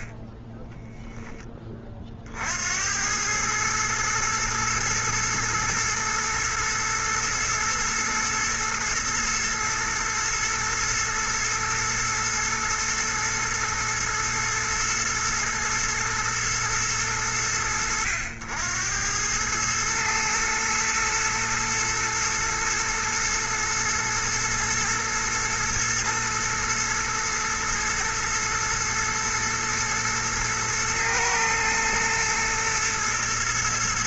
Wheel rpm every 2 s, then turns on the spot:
10, 70, 110, 110, 110, 110, 110, 110, 110, 90, 110, 110, 120, 110, 110, 110, 110.
0-2